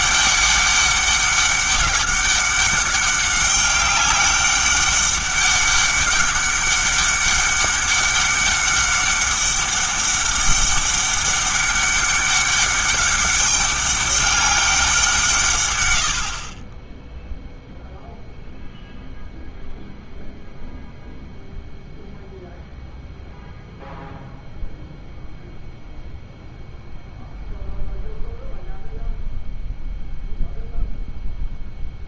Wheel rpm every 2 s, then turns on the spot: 200, 200, 200, 200, 200, 200, 200, 190, 10, 0, 0, 0, 0, 0, 0, 0.
none